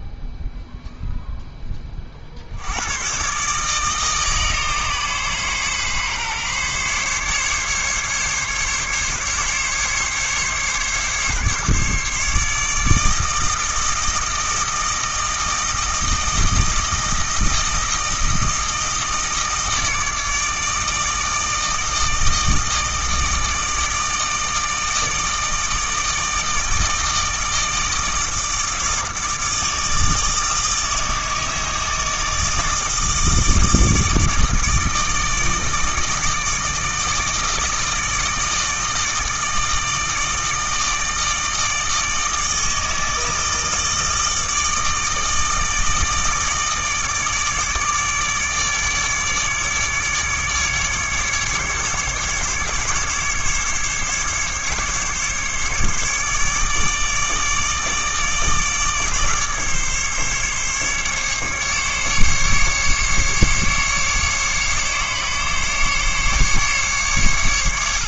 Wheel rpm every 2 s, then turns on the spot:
0, 100, 140, 140, 140, 140, 160, 160, 160, 160, 160, 160, 160, 160, 160, 160, 160, 160, 160, 160, 160, 160, 160, 160, 150, 150, 140, 140, 150, 150, 140, 140, 140, 140.
none